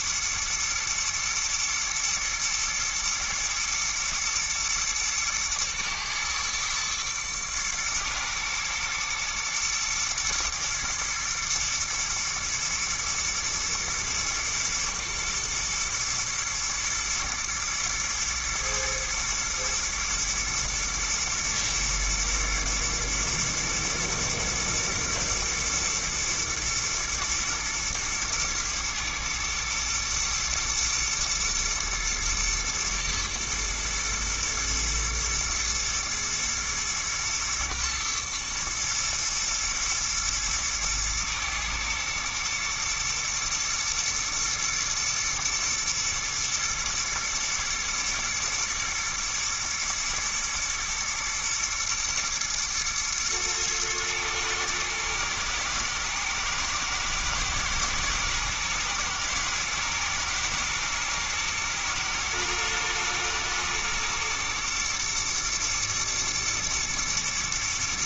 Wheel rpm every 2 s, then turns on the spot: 110, 110, 110, 110, 120, 120, 120, 110, 120, 120, 120, 110, 120, 110, 110, 110, 110, 120, 110, 110, 110, 110, 110, 110, 120, 120, 120, 110, 110, 120, 110, 110, 120, 120.
none